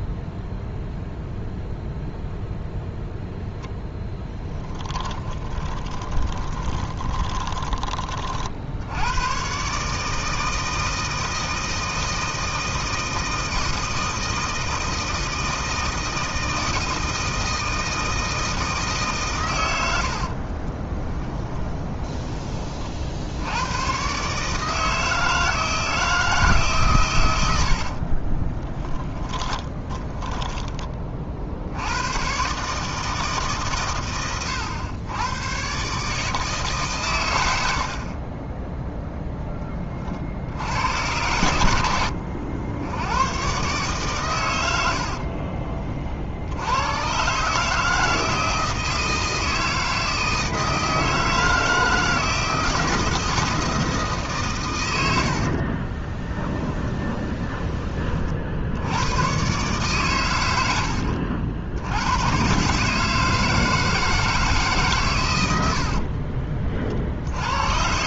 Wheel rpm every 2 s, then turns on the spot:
0, 0, 30, 20, 70, 160, 160, 160, 160, 150, 30, 40, 160, 130, 10, 20, 150, 100, 130, 0, 100, 80, 90, 100, 160, 160, 160, 130, 20, 80, 80, 140, 150, 40.
4-8 20-22 28-30 56-58